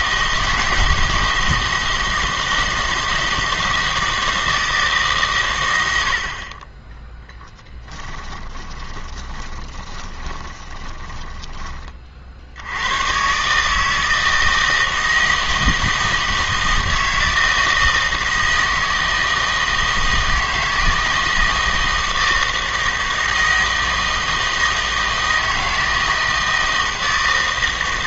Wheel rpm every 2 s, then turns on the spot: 160, 160, 160, 20, 20, 10, 80, 160, 160, 160, 160, 160, 160, 160.
8-12